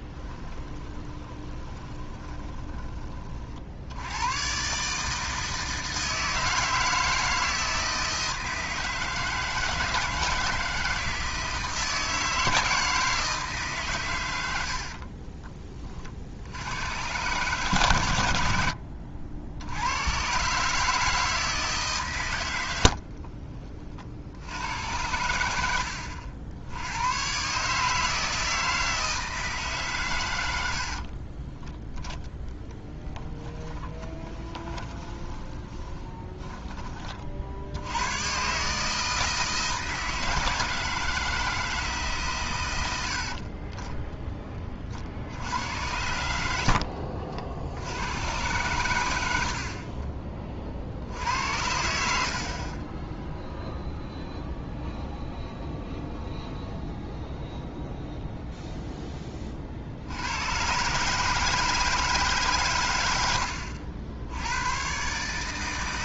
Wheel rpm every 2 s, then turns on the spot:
20, 30, 140, 160, 160, 160, 160, 70, 90, 80, 150, 80, 100, 90, 160, 70, 20, 20, 20, 150, 160, 100, 30, 60, 120, 50, 30, 0, 0, 0, 130, 110, 120.
0-2 14-16 22-24 30-36 46-48